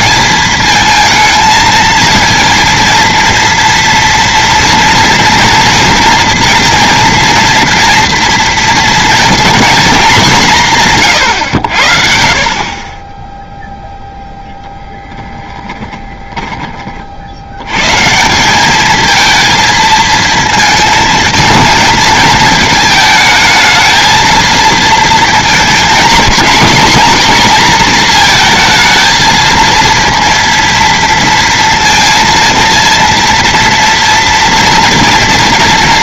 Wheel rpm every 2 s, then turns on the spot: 220, 230, 230, 230, 230, 170, 40, 10, 40, 200, 220, 220, 230, 220, 220, 230, 230, 230.
14-16